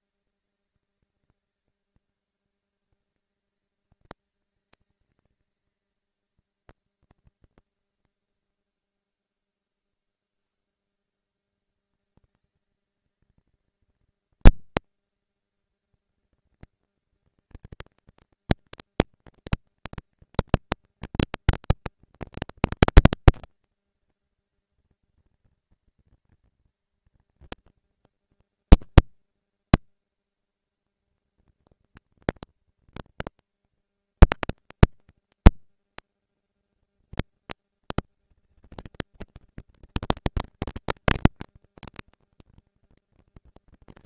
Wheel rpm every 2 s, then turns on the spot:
200, 210, 220, 230, 140, 110, 230, 230, 230, 230, 230, 230, 240, 230, 230, 230, 230, 230, 240, 230, 230, 230.
none